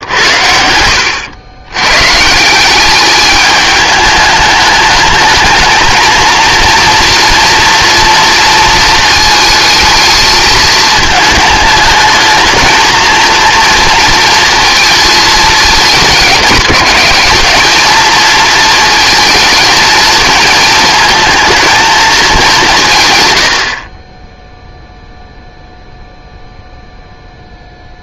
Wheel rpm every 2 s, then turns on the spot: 90, 200, 210, 240, 230, 220, 230, 230, 200, 230, 220, 160, 0, 0.
none